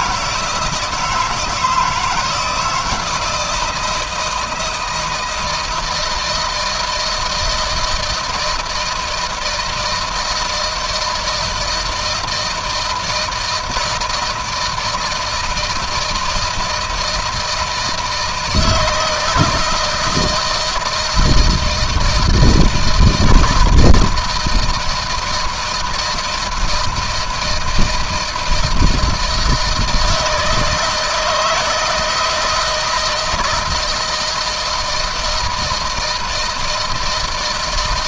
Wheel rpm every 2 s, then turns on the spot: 160, 170, 160, 160, 160, 160, 160, 160, 160, 160, 160, 160, 160, 160, 160, 160, 160, 160, 160.
none